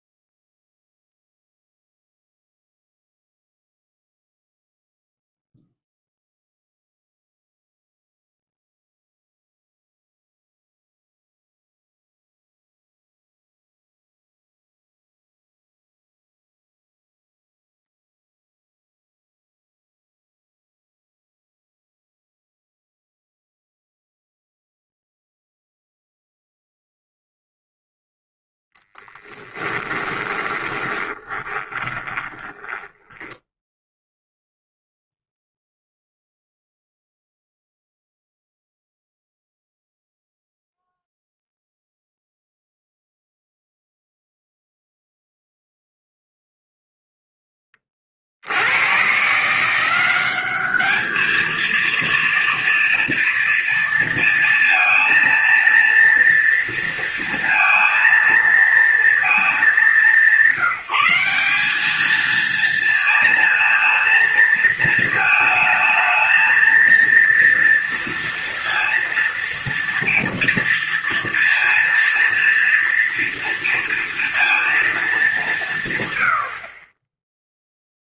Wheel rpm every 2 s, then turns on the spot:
0, 0, 0, 0, 0, 0, 0, 0, 0, 0, 0, 0, 0, 0, 0, 20, 20, 0, 0, 0, 0, 0, 0, 0, 80, 210, 230, 230, 230, 230, 190, 230, 230, 220, 230, 230, 230, 230, 120.
30-34